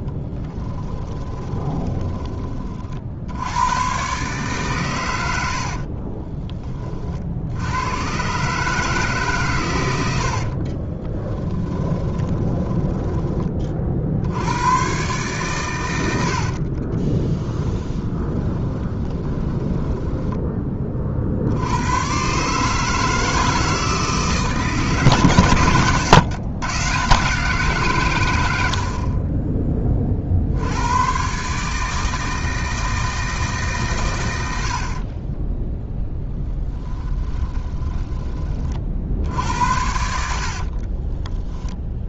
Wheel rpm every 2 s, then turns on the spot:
20, 70, 120, 40, 150, 20, 10, 120, 40, 20, 30, 150, 140, 130, 60, 90, 160, 60, 10, 60, 30.
0-2 10-12 16-20 34-38 40-42